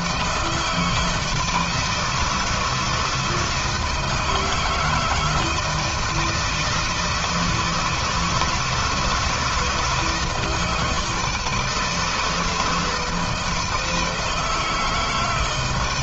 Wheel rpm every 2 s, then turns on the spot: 160, 160, 160, 160, 160, 160, 160, 150.
none